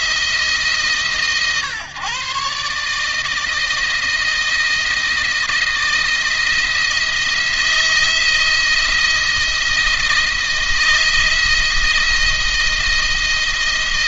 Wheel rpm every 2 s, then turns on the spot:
150, 140, 170, 170, 170, 160, 170.
none